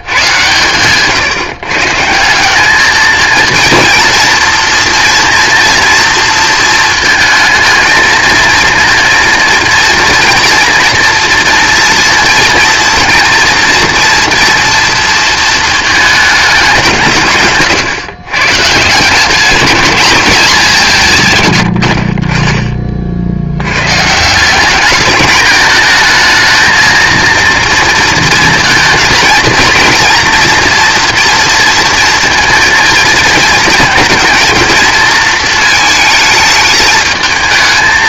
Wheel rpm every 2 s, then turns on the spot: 130, 200, 230, 230, 230, 240, 230, 230, 210, 150, 200, 40, 200, 230, 230, 230, 220, 230, 220.
none